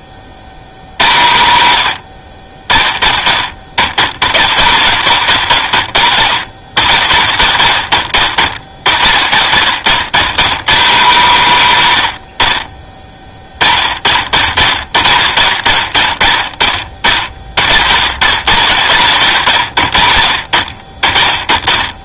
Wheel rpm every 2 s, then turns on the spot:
90, 30, 70, 40, 40, 160, 60, 70, 30, 80, 50.
none